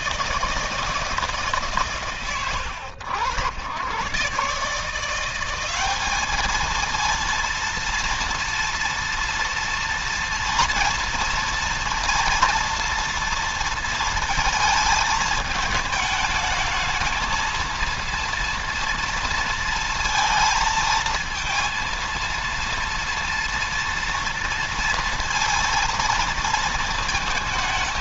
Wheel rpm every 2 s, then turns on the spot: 160, 90, 160, 220, 230, 240, 230, 220, 220, 230, 230, 230, 230, 220.
none